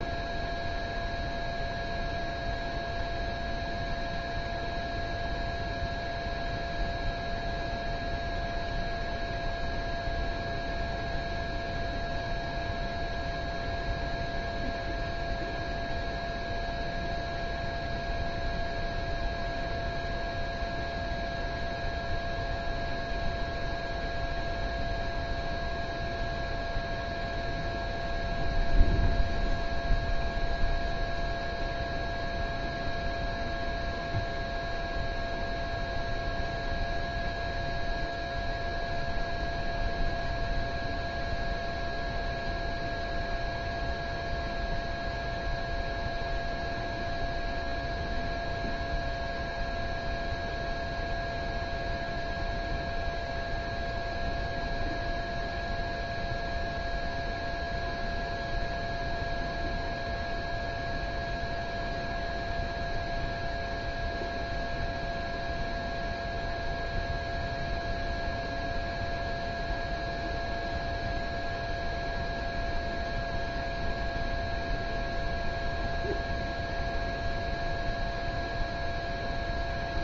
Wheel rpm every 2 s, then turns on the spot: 0, 0, 0, 0, 0, 0, 0, 0, 0, 0, 0, 0, 0, 0, 0, 0, 0, 0, 0, 0, 0, 0, 0, 0, 0, 0, 0, 0, 0, 0, 0, 0, 0, 0, 0, 0, 0, 0, 0, 0.
none